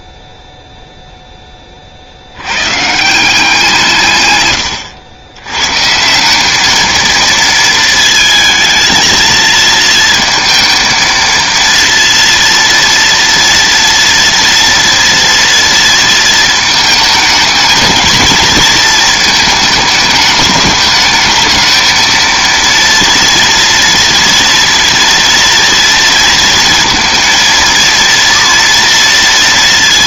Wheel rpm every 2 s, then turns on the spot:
0, 140, 110, 220, 220, 220, 230, 230, 220, 230, 210, 230, 240, 230, 230.
4-6